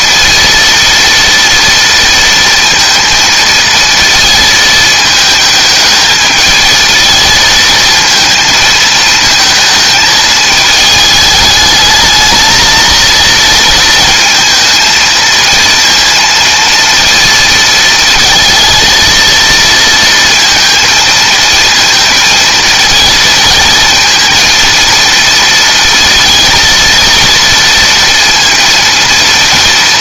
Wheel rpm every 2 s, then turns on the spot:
230, 230, 230, 220, 220, 220, 220, 220, 230, 230, 230, 230, 230, 230, 230.
none